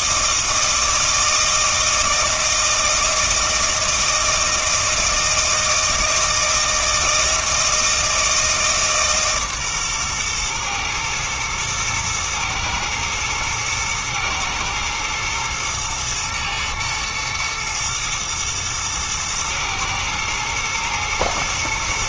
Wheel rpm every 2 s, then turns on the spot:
160, 160, 160, 160, 150, 120, 120, 110, 110, 110, 120.
none